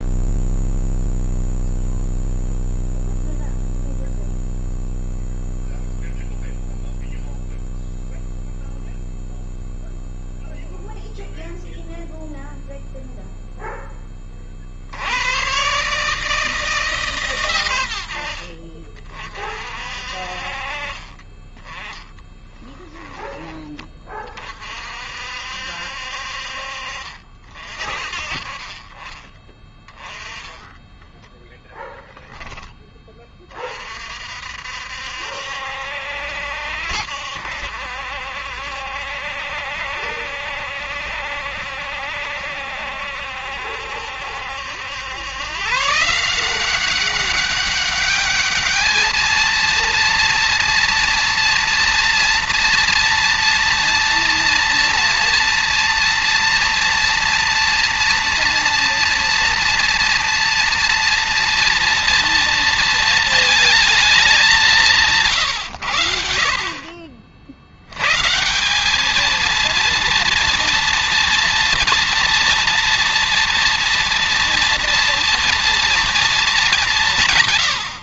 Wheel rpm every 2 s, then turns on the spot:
0, 0, 0, 0, 0, 0, 0, 80, 130, 40, 30, 10, 50, 50, 30, 10, 20, 60, 70, 70, 70, 70, 100, 190, 220, 230, 230, 230, 230, 230, 230, 230, 160, 50, 200, 230, 230, 240, 170.
30-32